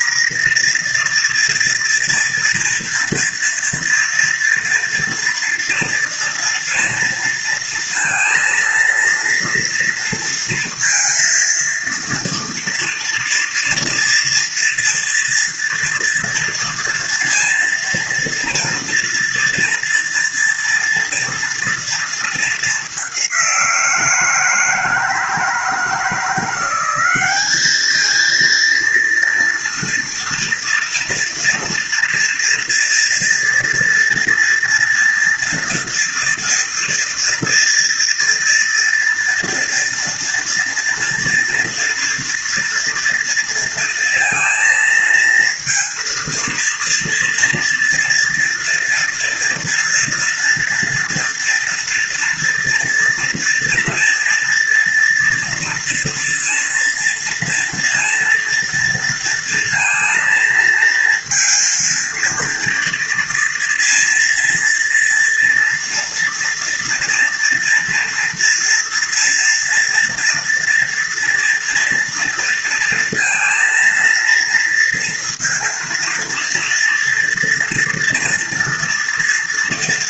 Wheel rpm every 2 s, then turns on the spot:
250, 230, 230, 230, 230, 230, 230, 230, 230, 230, 230, 220, 160, 170, 220, 230, 230, 230, 240, 230, 230, 230, 230, 230, 230, 230, 230, 230, 230, 230, 230, 230, 230, 230, 230, 230, 230, 230, 230, 230.
none